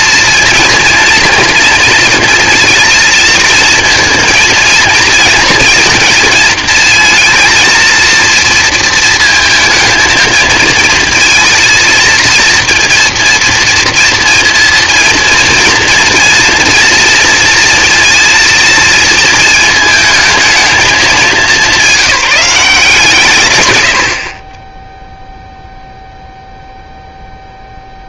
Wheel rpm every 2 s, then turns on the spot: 230, 220, 220, 220, 230, 220, 230, 230, 230, 230, 220, 190, 30, 0.
none